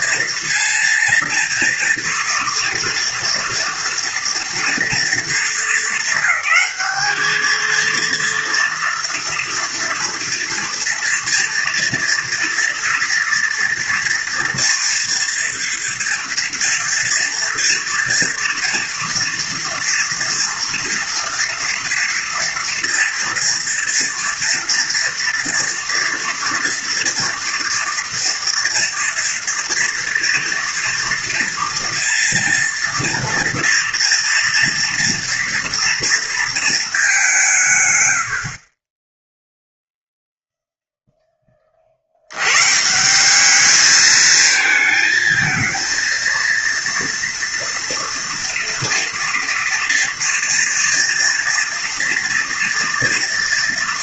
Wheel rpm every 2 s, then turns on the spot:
230, 230, 230, 200, 230, 230, 230, 230, 230, 230, 230, 230, 230, 230, 230, 240, 230, 230, 220, 40, 0, 120, 220, 230, 230, 230, 230.
none